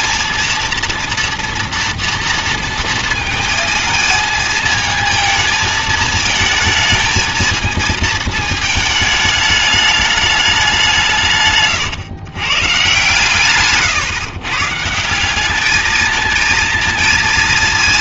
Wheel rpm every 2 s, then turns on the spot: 230, 230, 230, 220, 220, 190, 120, 140, 220.
none